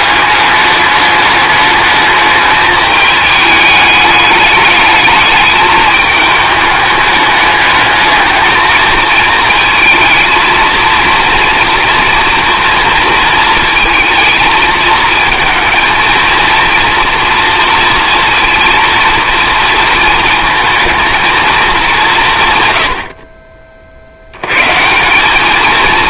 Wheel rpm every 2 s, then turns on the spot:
210, 210, 210, 210, 220, 230, 230, 220, 230, 230, 230, 100, 150.
none